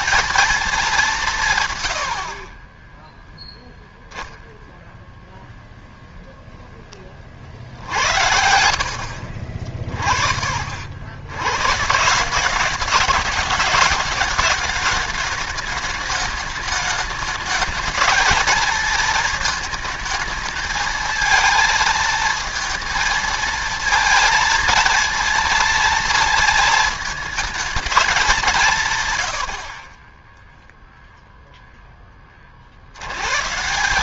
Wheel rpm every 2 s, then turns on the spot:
220, 30, 0, 10, 70, 60, 190, 220, 210, 220, 220, 230, 230, 220, 170, 0, 60.
none